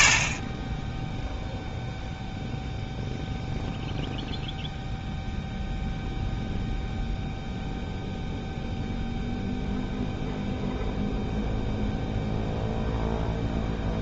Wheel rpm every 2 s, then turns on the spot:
10, 0, 0, 0, 0, 0, 0.
none